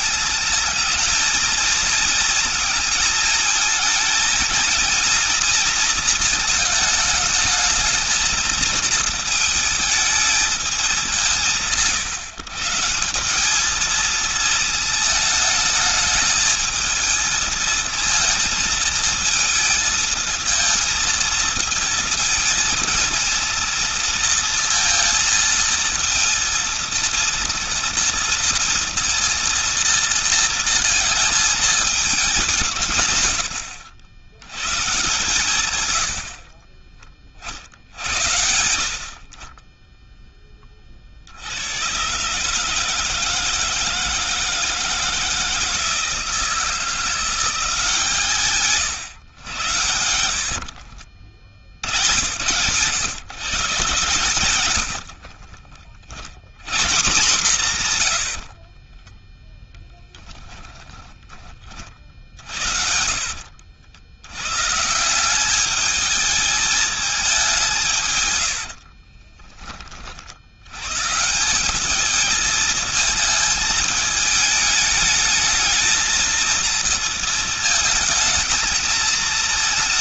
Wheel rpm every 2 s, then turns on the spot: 220, 220, 230, 220, 220, 200, 160, 220, 220, 230, 220, 230, 230, 230, 230, 230, 160, 130, 50, 70, 30, 150, 160, 160, 140, 70, 120, 110, 120, 60, 10, 60, 140, 210, 60, 100, 220, 210, 230, 220.
36-38 50-52 58-64 68-70